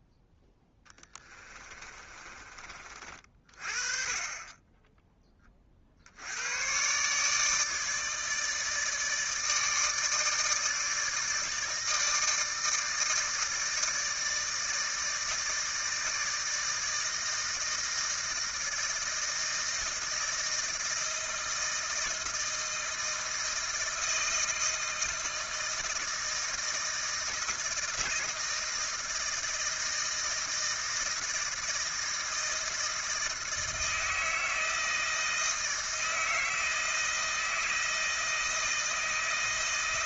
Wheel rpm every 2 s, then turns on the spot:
10, 40, 10, 120, 160, 160, 160, 160, 160, 160, 160, 160, 160, 160, 160, 160, 160, 160, 160, 160.
0-2